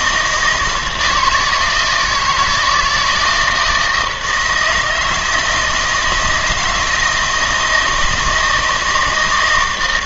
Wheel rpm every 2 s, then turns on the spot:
160, 160, 160, 170, 160.
none